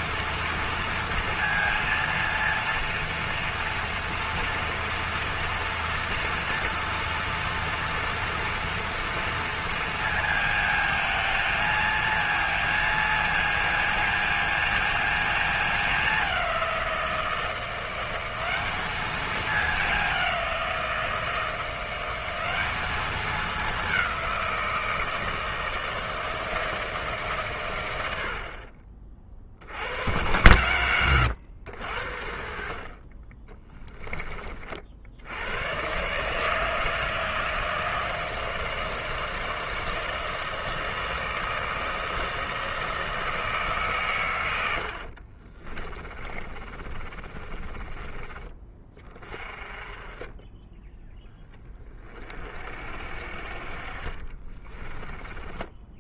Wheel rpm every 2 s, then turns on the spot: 230, 230, 230, 230, 230, 220, 230, 230, 180, 200, 180, 200, 170, 160, 40, 110, 50, 40, 160, 160, 160, 160, 100, 30, 20, 10, 50, 30.
44-48 54-56